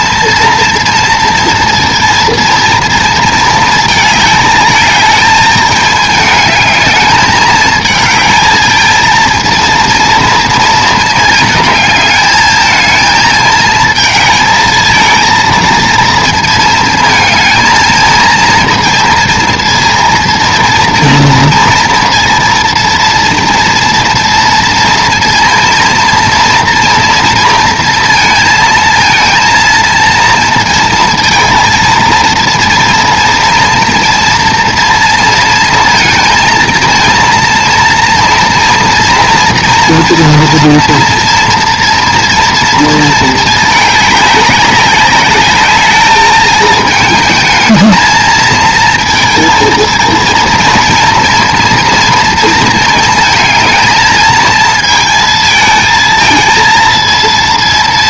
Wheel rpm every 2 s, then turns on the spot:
230, 230, 220, 210, 220, 220, 220, 220, 220, 230, 230, 230, 230, 230, 230, 230, 230, 230, 230, 230, 230, 230, 200, 220, 230, 230, 220, 220, 230.
none